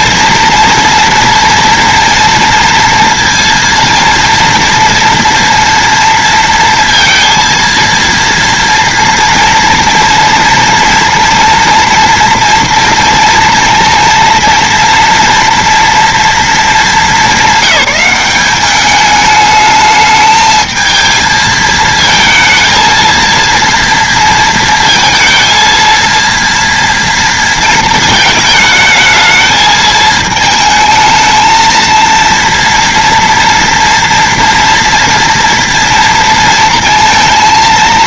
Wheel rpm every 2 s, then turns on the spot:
230, 230, 240, 230, 230, 230, 230, 240, 220, 200, 220, 230, 230, 230, 220, 220, 230, 230, 230.
none